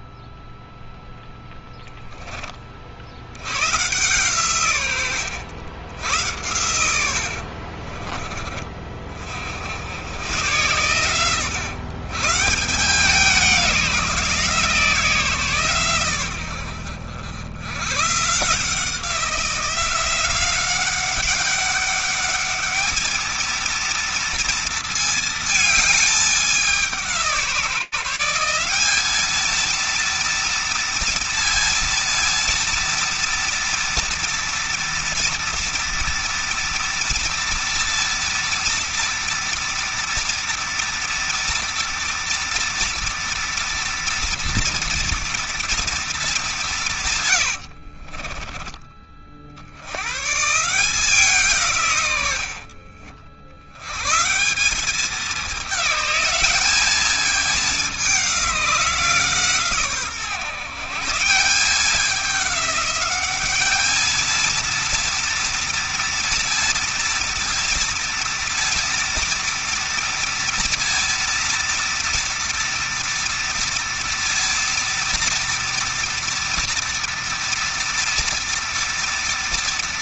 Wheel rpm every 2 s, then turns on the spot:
0, 70, 110, 90, 50, 120, 170, 160, 100, 170, 190, 220, 220, 170, 210, 230, 230, 230, 230, 230, 230, 230, 230, 140, 50, 160, 90, 200, 210, 150, 180, 210, 230, 230, 230, 230, 230, 230, 230, 230.
6-8 46-48